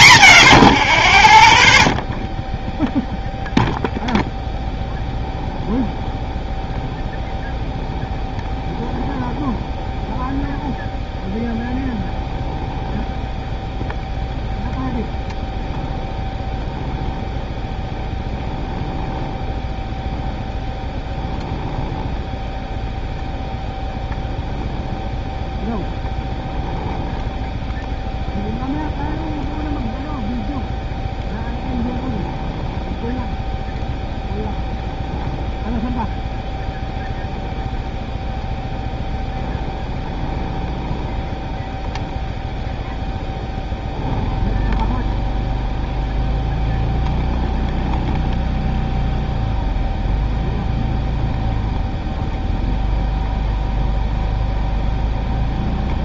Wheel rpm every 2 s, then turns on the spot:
30, 0, 0, 0, 0, 0, 0, 0, 0, 0, 0, 0, 0, 0, 0, 0, 0, 0, 0, 0, 0, 0, 0, 0, 0, 0, 0, 0.
none